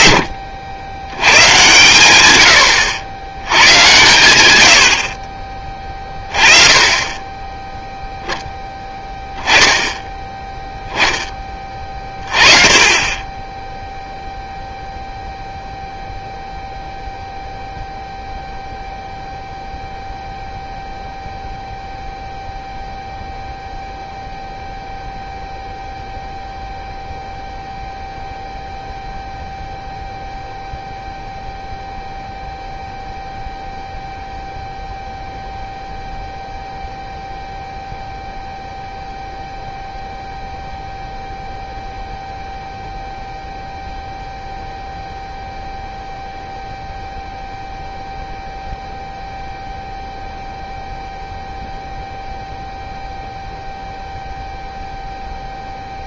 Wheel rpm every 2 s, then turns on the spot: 100, 100, 90, 20, 0, 10, 20, 0, 0, 0, 0, 0, 0, 0, 0, 0, 0, 0, 0, 0, 0, 0, 0, 0, 0, 0, 0, 0.
none